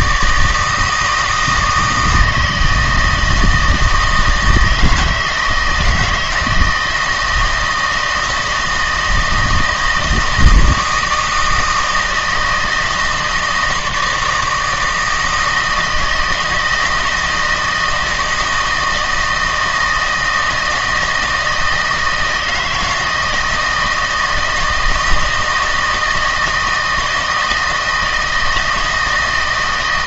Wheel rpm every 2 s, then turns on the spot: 160, 160, 160, 160, 160, 160, 160, 160, 160, 160, 160, 160, 160, 160, 150.
none